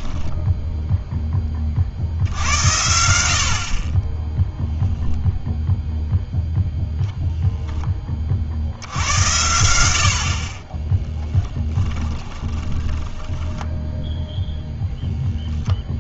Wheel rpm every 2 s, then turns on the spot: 0, 90, 0, 0, 70, 30, 10, 0.
12-14